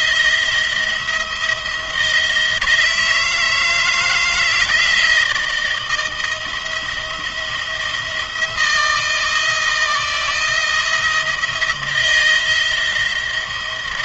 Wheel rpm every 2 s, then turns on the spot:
170, 160, 170, 160, 160, 170, 170.
none